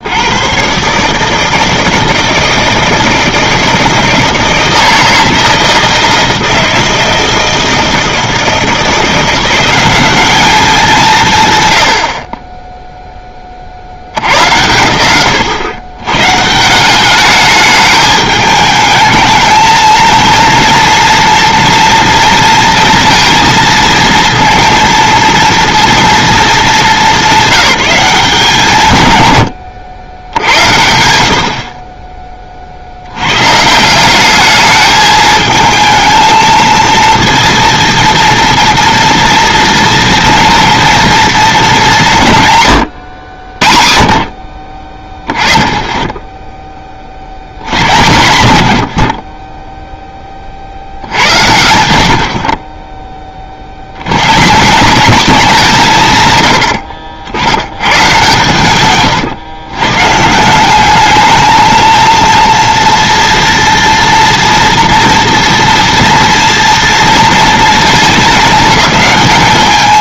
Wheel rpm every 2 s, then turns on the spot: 110, 160, 160, 160, 170, 200, 10, 110, 180, 210, 230, 230, 230, 210, 150, 80, 60, 210, 220, 230, 230, 120, 30, 20, 90, 60, 30, 180, 80, 130, 180, 240, 230, 230, 210.
none